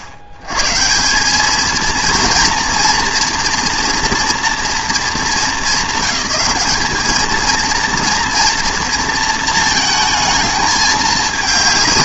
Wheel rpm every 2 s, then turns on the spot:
100, 230, 230, 210, 230, 220.
none